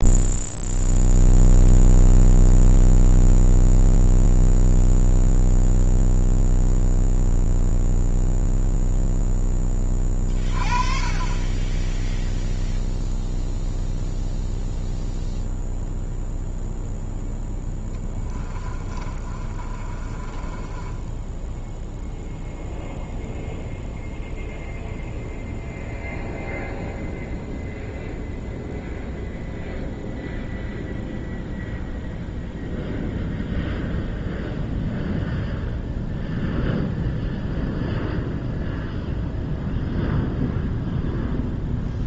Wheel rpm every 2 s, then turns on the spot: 0, 0, 0, 0, 0, 30, 0, 0, 0, 20, 20, 0, 0, 0, 0, 0, 0, 0, 0, 0, 0.
18-22